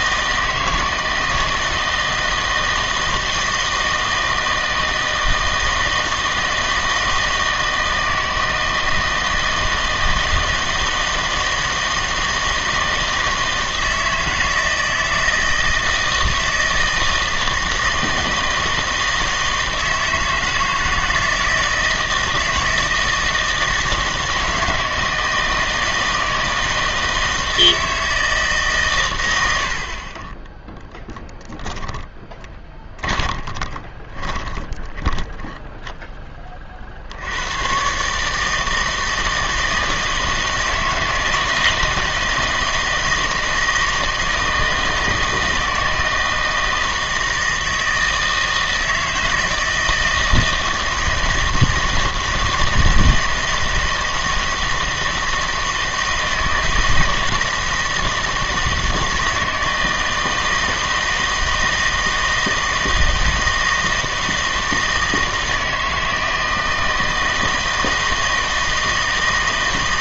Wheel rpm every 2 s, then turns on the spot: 160, 160, 160, 160, 160, 160, 160, 160, 160, 160, 160, 160, 160, 160, 150, 10, 20, 20, 30, 160, 160, 160, 160, 160, 160, 160, 160, 160, 160, 170, 160, 160, 160, 160, 160.
32-36